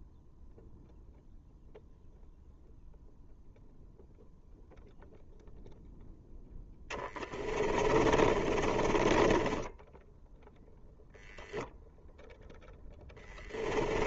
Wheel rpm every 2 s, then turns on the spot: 0, 0, 0, 10, 30, 0, 0.
6-10